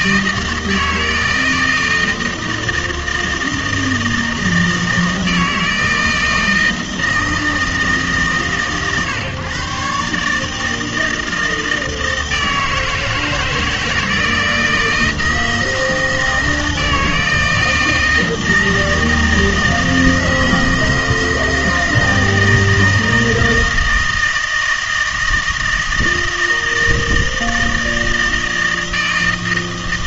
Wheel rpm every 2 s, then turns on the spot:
160, 160, 160, 160, 140, 160, 160, 160, 160, 160, 160, 160, 160, 160, 160.
none